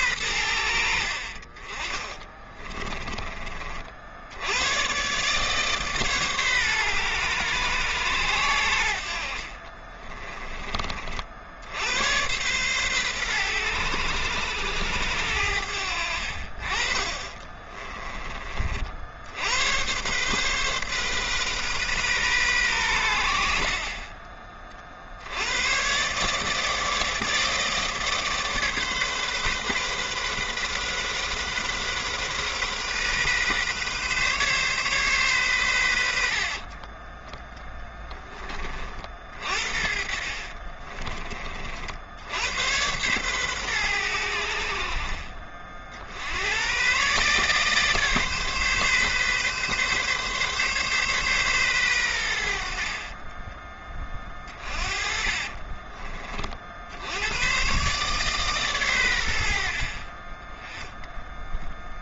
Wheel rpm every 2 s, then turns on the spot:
80, 20, 100, 130, 90, 20, 120, 90, 40, 40, 130, 110, 40, 160, 150, 130, 130, 140, 40, 30, 40, 100, 70, 110, 140, 140, 60, 30, 60, 130, 10.
2-4 36-38 40-42 54-56